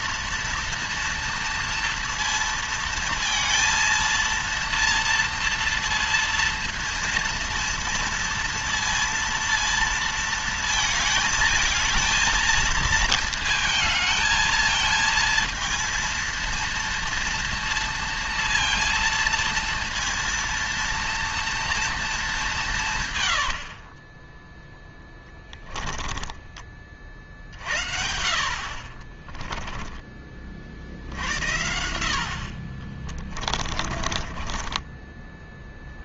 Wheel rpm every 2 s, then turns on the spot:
230, 230, 230, 230, 230, 230, 230, 220, 230, 230, 230, 190, 10, 20, 60, 50, 70, 30.
24-26 34-36